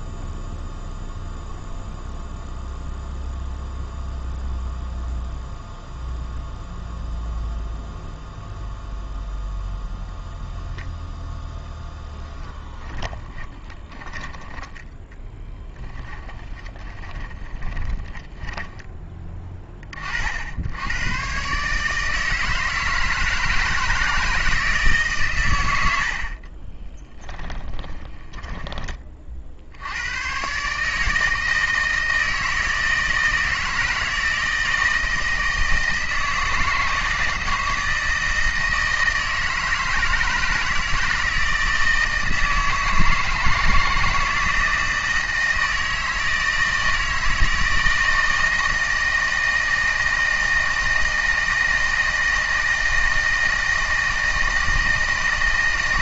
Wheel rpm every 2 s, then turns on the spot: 0, 0, 0, 0, 0, 0, 10, 10, 30, 20, 90, 160, 160, 30, 10, 130, 160, 160, 160, 160, 160, 160, 160, 160, 160, 160, 160, 160.
12-18 26-28